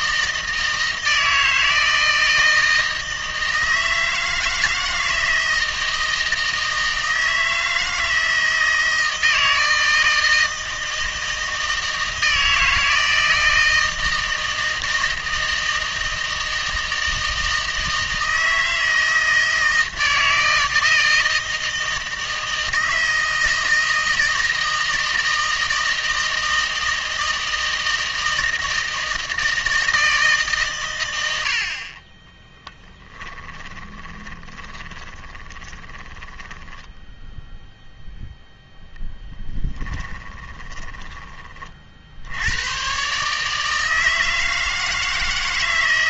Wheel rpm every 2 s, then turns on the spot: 160, 160, 160, 160, 160, 160, 160, 160, 160, 160, 160, 160, 160, 160, 160, 130, 10, 30, 10, 0, 20, 110, 160.
32-38 40-42